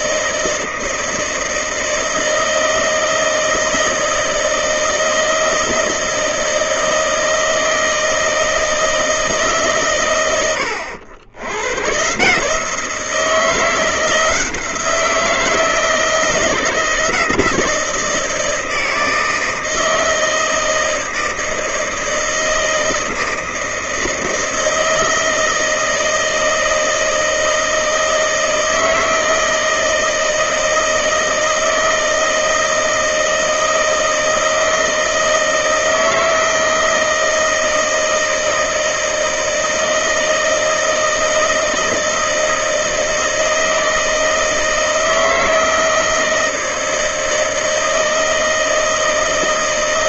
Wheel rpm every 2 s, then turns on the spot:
160, 160, 160, 160, 160, 100, 160, 170, 160, 160, 160, 160, 160, 160, 160, 160, 160, 160, 160, 160, 160, 160, 160, 160, 160.
none